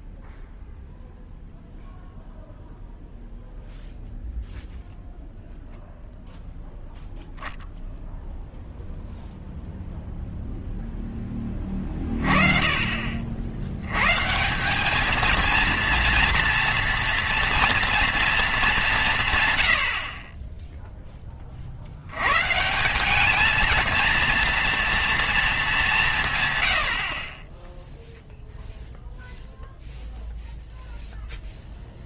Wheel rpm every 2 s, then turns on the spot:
0, 0, 0, 0, 0, 0, 30, 170, 240, 210, 10, 160, 230, 80, 0, 0.
none